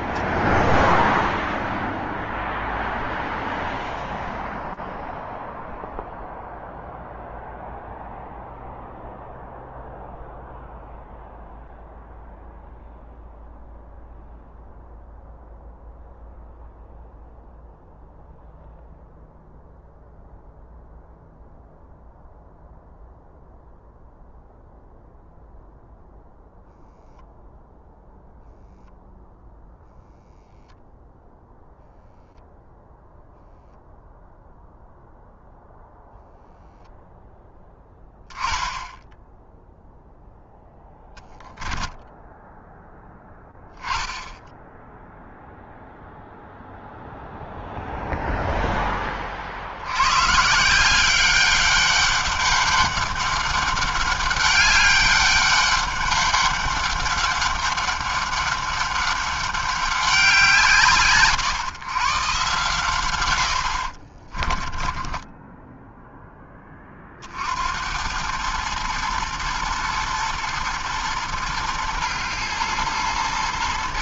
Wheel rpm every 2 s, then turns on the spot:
0, 0, 0, 0, 0, 0, 0, 0, 0, 0, 0, 0, 0, 0, 0, 0, 0, 0, 0, 0, 0, 0, 0, 0, 0, 130, 200, 200, 200, 200, 170, 130, 30, 10, 110, 120, 120.
64-66